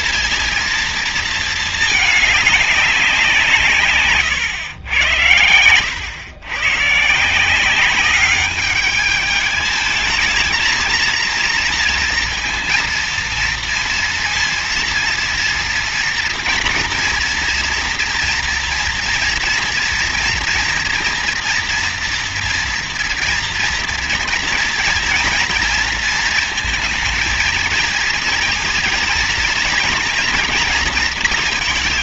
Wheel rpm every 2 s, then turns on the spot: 230, 190, 100, 130, 210, 230, 230, 230, 230, 230, 230, 240, 230, 230, 230, 230.
none